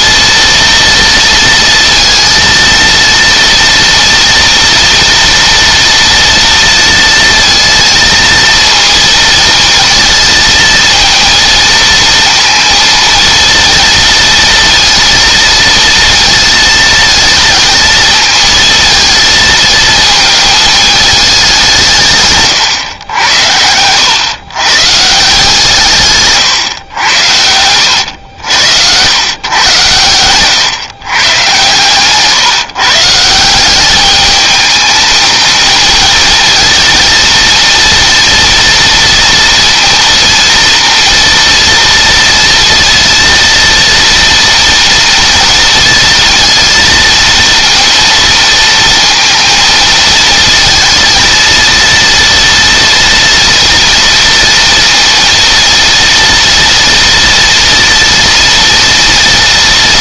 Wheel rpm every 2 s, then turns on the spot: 230, 230, 230, 230, 230, 230, 230, 230, 230, 220, 210, 100, 140, 110, 100, 130, 160, 220, 220, 230, 230, 230, 230, 230, 230, 230, 230, 230, 230, 230.
none